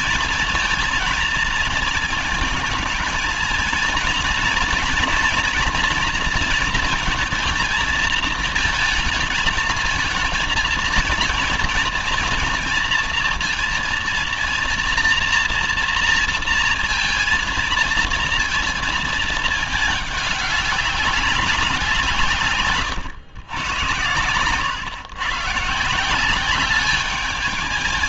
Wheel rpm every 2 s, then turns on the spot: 230, 220, 230, 230, 220, 230, 230, 230, 230, 220, 200, 100, 140, 210.
none